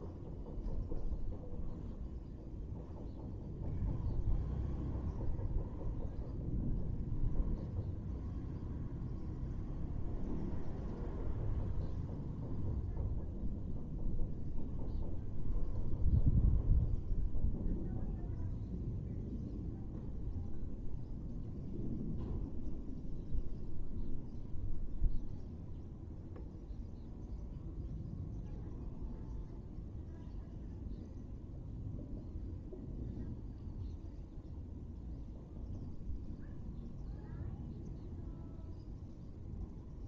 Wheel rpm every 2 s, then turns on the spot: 0, 0, 0, 0, 0, 0, 0, 0, 0, 0, 0, 0, 0, 0, 0, 0, 0, 0, 0, 0.
none